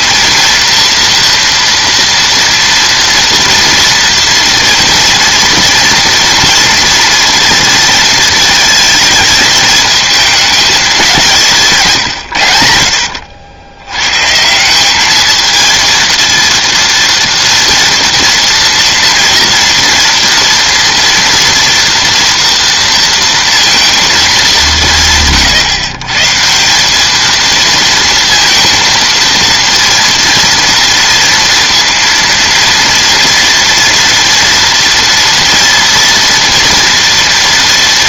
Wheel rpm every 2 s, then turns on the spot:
230, 230, 230, 230, 220, 200, 70, 190, 230, 230, 240, 230, 170, 190, 230, 230, 230, 230, 230.
none